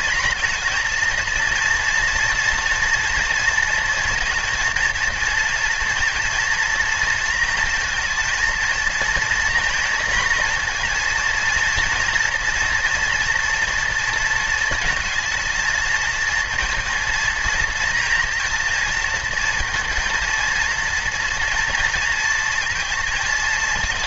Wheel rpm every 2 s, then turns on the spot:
230, 230, 230, 230, 230, 240, 230, 230, 230, 230, 230, 220.
none